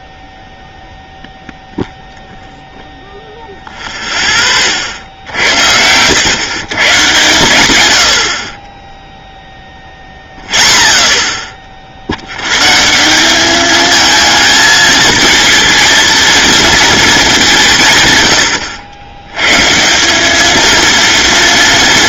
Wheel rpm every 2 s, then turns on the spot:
0, 0, 50, 120, 20, 0, 150, 220, 220, 90, 230.
none